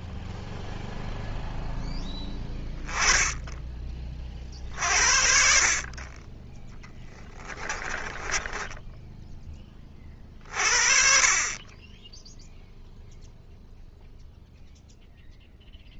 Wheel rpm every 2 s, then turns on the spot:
0, 20, 40, 20, 10, 50, 0, 0.
8-10